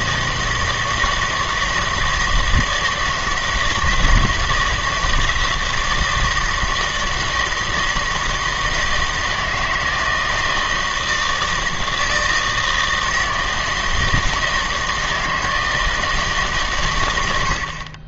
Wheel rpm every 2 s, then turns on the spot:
160, 160, 160, 160, 160, 160, 160, 160, 140.
none